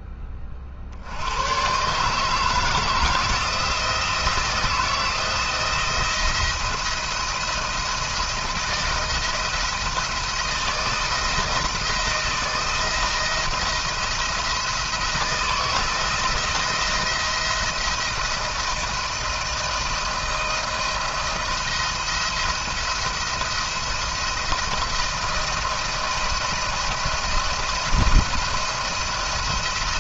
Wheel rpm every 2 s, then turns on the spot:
50, 160, 160, 170, 170, 170, 160, 160, 170, 160, 170, 170, 170, 170, 170.
none